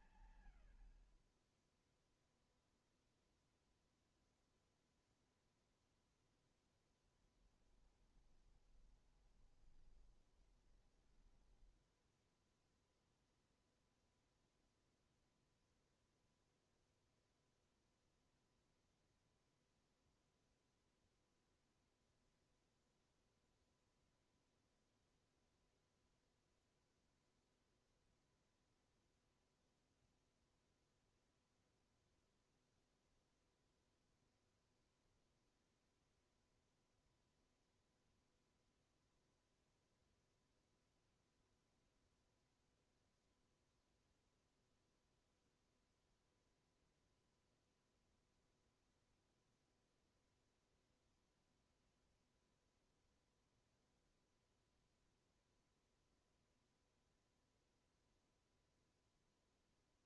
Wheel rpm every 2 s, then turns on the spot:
120, 0, 0, 0, 20, 20, 0, 0, 0, 0, 0, 0, 0, 0, 0, 0, 0, 0, 0, 0, 0, 0, 0, 0, 0, 0, 0, 0, 0, 0.
8-12